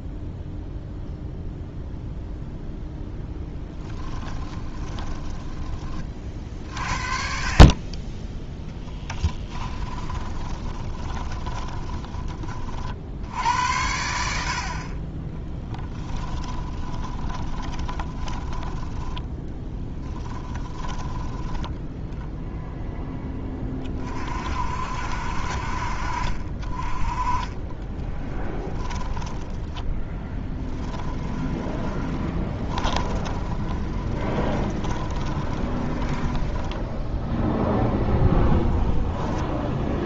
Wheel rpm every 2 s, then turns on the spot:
0, 10, 20, 50, 10, 20, 70, 30, 10, 10, 10, 10, 60, 20, 10, 10, 20, 20, 10, 0.
4-6 8-12 16-22 28-38